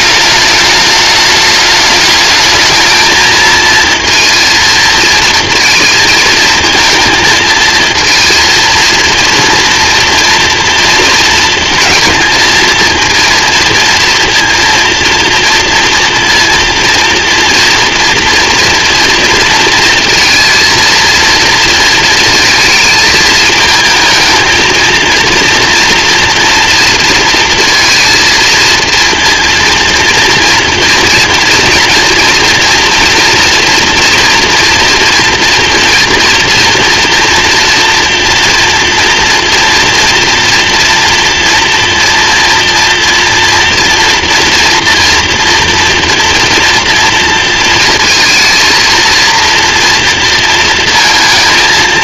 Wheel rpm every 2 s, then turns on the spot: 210, 210, 220, 230, 230, 230, 220, 230, 230, 230, 230, 220, 220, 230, 230, 230, 240, 230, 230, 230, 230, 230, 230, 230, 230, 220.
none